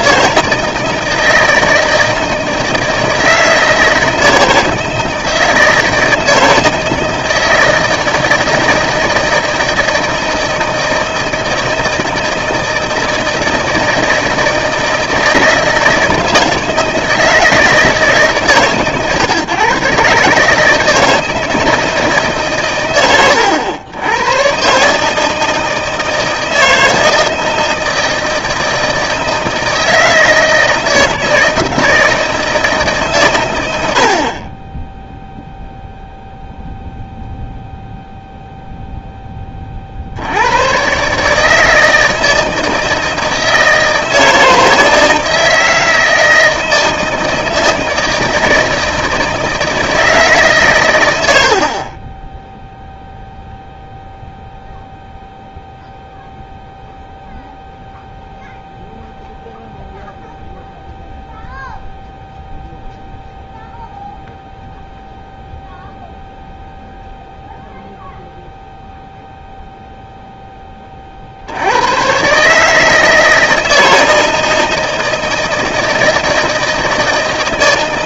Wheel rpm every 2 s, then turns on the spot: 160, 160, 160, 160, 160, 160, 160, 160, 160, 140, 160, 130, 130, 160, 160, 160, 160, 20, 0, 0, 100, 160, 160, 160, 160, 140, 0, 0, 0, 0, 0, 0, 0, 0, 0, 10, 150, 160, 160.
none